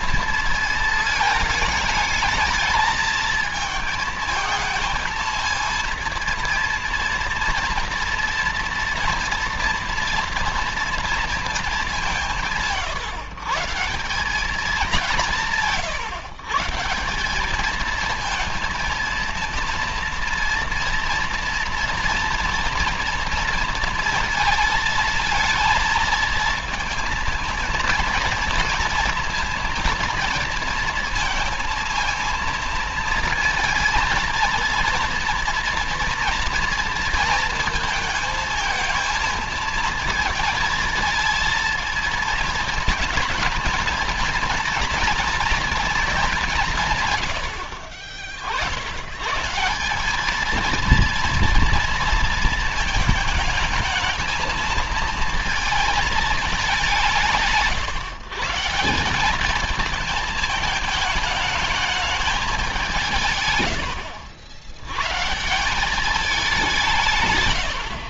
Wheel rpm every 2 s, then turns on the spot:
220, 230, 230, 230, 230, 230, 130, 190, 180, 230, 240, 230, 220, 230, 230, 230, 220, 230, 230, 220, 220, 220, 230, 120, 120, 230, 220, 220, 160, 190, 220, 160, 130, 140.
none